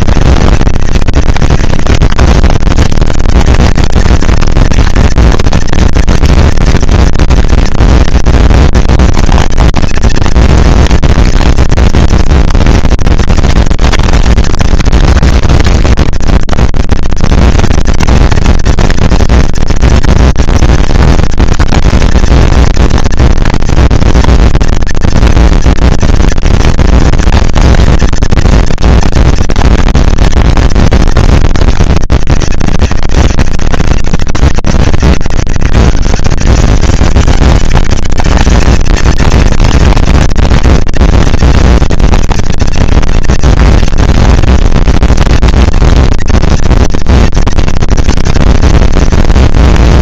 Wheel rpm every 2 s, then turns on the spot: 190, 210, 230, 230, 230, 230, 230, 230, 230, 230, 230, 230, 230, 230, 240, 230, 200, 200, 210, 220, 230, 230, 230, 230, 230.
none